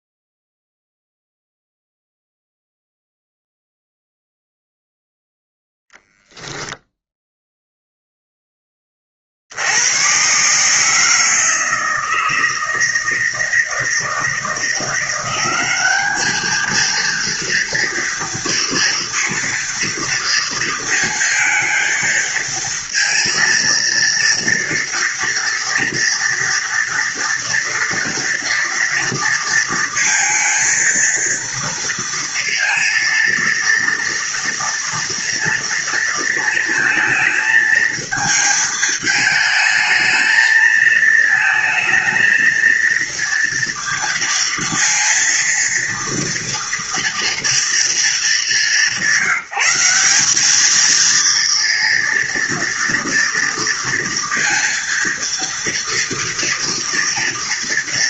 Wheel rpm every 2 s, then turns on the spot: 0, 0, 0, 0, 20, 150, 160, 170, 220, 230, 230, 230, 230, 230, 230, 230, 230, 230, 230, 220, 220, 230, 230, 230, 190, 220, 230, 230, 230.
none